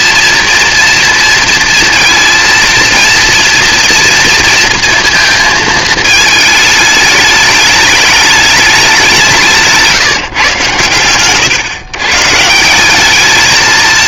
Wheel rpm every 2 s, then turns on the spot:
230, 230, 230, 210, 180, 120, 210.
none